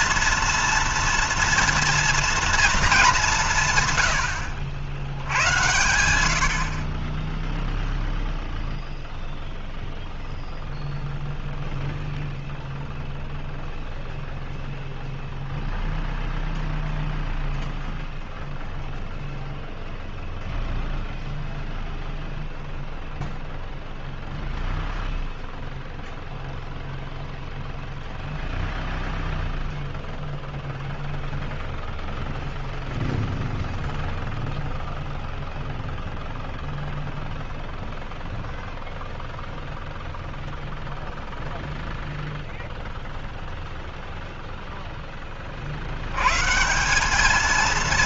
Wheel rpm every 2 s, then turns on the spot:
230, 230, 100, 70, 0, 0, 0, 0, 0, 0, 0, 0, 0, 0, 0, 0, 0, 0, 0, 0, 0, 0, 0, 130.
none